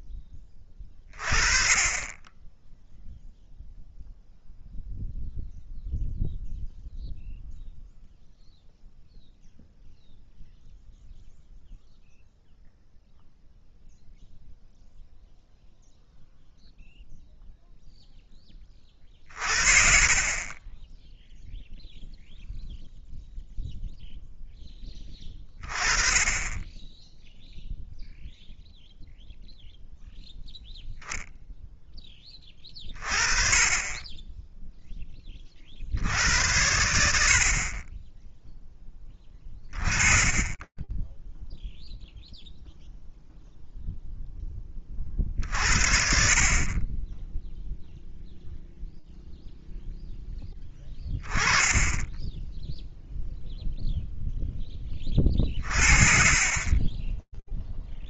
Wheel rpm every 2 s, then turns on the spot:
20, 0, 0, 0, 0, 0, 0, 0, 0, 30, 20, 0, 10, 10, 0, 0, 20, 10, 90, 10, 10, 0, 40, 20, 0, 10, 0, 30, 10.
none